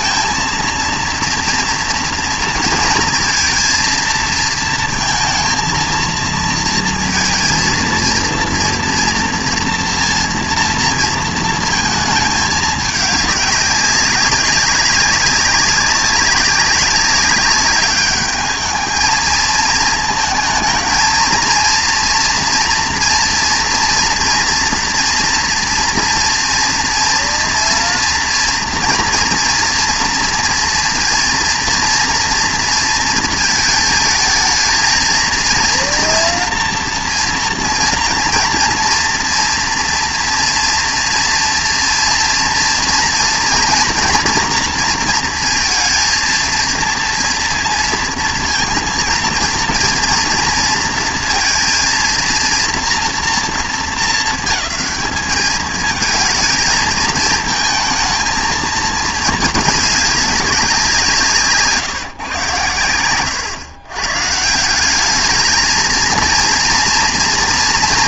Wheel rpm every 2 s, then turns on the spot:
230, 230, 230, 230, 230, 230, 210, 200, 200, 210, 220, 240, 230, 230, 230, 230, 230, 220, 230, 230, 230, 230, 240, 230, 230, 230, 230, 220, 220, 220, 190, 110, 160, 230.
none